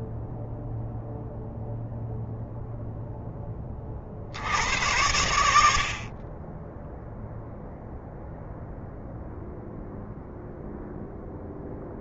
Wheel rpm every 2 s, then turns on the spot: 0, 0, 80, 20, 0, 0.
none